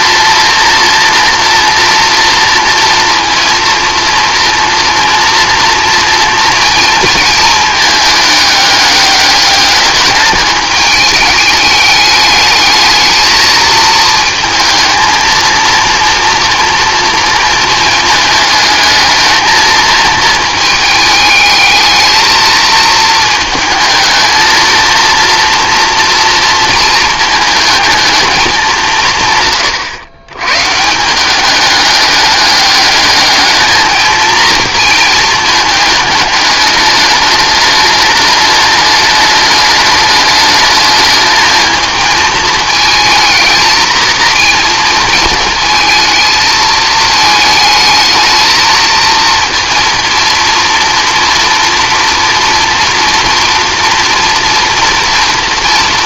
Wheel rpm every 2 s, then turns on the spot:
230, 230, 230, 230, 210, 210, 220, 230, 230, 220, 220, 220, 230, 230, 180, 150, 210, 230, 210, 210, 220, 230, 220, 220, 220, 230, 230, 230.
none